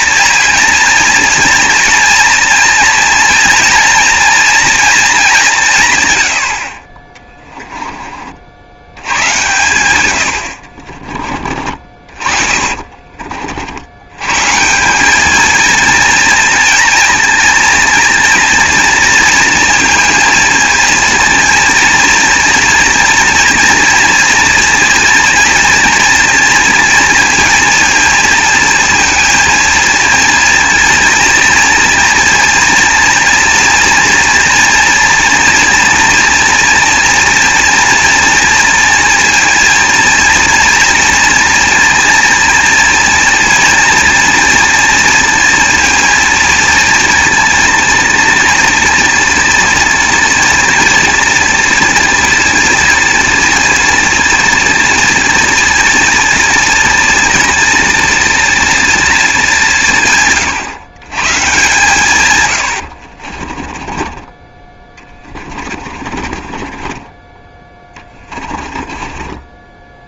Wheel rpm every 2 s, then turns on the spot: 230, 230, 230, 40, 80, 50, 40, 160, 230, 230, 230, 230, 230, 230, 230, 230, 230, 230, 240, 230, 230, 230, 230, 230, 230, 240, 230, 230, 230, 230, 130, 90, 20, 30, 20.
10-14 62-64 66-70